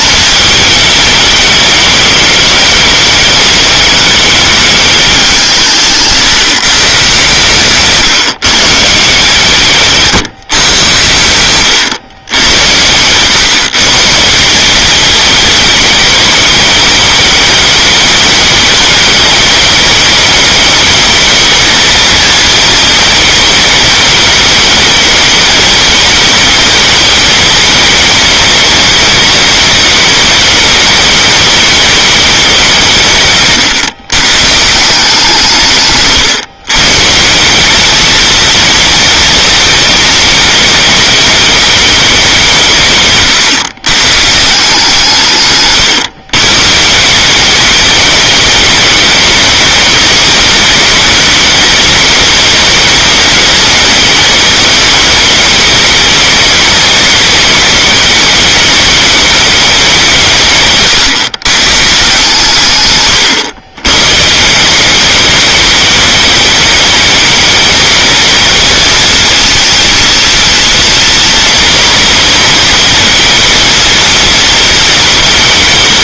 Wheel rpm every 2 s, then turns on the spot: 220, 220, 210, 150, 160, 130, 110, 180, 210, 210, 210, 230, 220, 210, 210, 210, 190, 150, 140, 230, 220, 170, 160, 140, 210, 210, 210, 210, 210, 220, 150, 140, 160, 200, 220, 230, 230, 230.
none